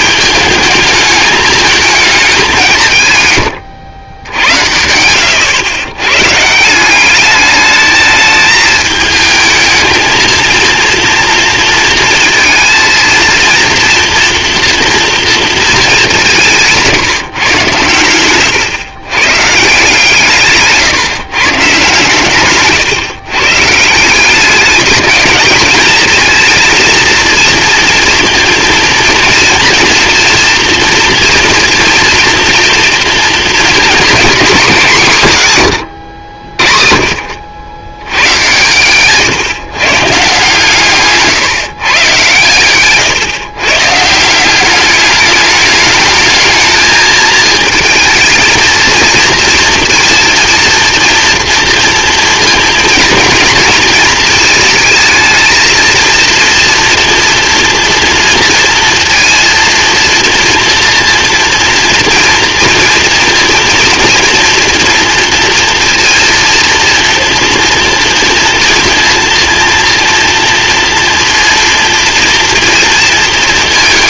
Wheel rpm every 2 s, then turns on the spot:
210, 180, 90, 160, 220, 230, 230, 230, 160, 120, 150, 140, 210, 230, 230, 230, 230, 220, 60, 120, 150, 120, 200, 220, 220, 240, 230, 220, 230, 230, 230, 230, 240, 230, 230, 230, 230.
20-22